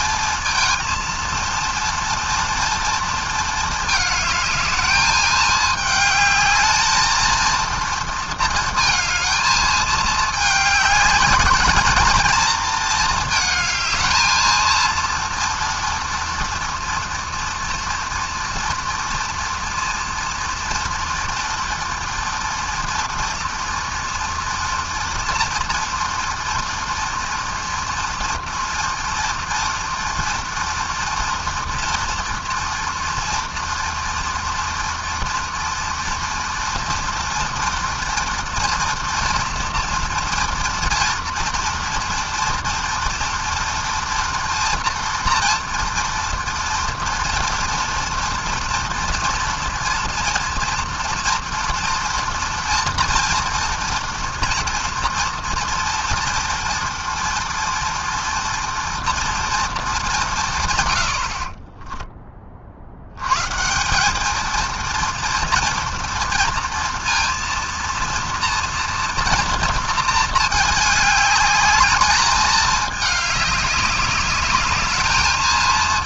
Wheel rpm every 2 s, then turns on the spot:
230, 220, 210, 220, 220, 210, 220, 230, 230, 230, 230, 230, 230, 230, 230, 230, 230, 230, 230, 230, 230, 230, 230, 230, 230, 230, 230, 230, 230, 230, 60, 120, 230, 230, 230, 210, 210, 210.
none